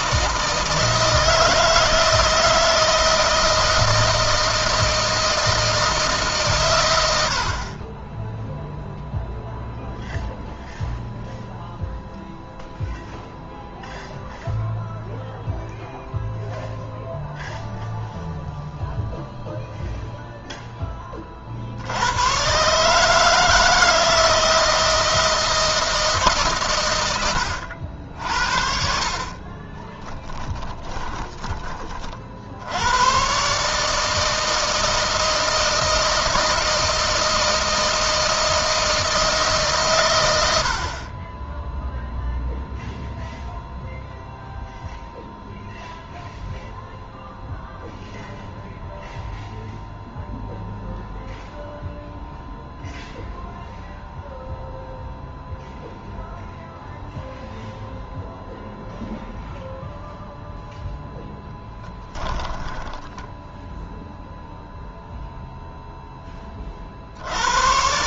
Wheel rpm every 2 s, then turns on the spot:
160, 160, 160, 110, 0, 0, 0, 0, 0, 0, 20, 140, 160, 110, 60, 10, 100, 160, 160, 160, 60, 0, 0, 0, 0, 0, 0, 0, 0, 0, 0, 10, 0, 60.
28-32 62-64